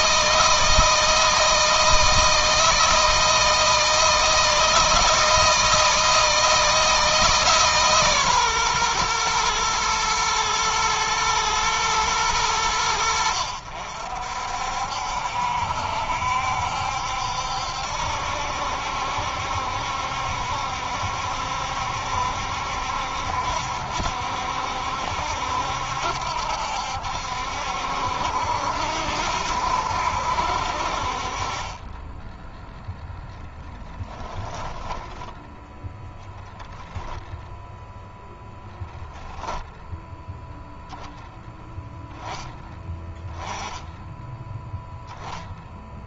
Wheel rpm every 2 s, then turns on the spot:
160, 160, 160, 160, 130, 110, 90, 60, 70, 70, 70, 70, 70, 70, 70, 60, 10, 20, 0, 0, 0, 10, 0.
34-36